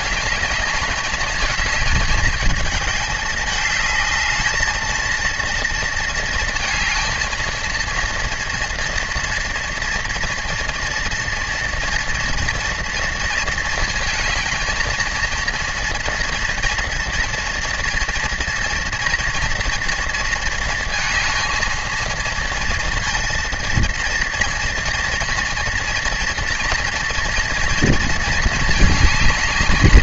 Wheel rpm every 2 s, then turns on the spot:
210, 210, 220, 220, 230, 230, 230, 220, 230, 230, 230, 230, 230, 230, 220.
none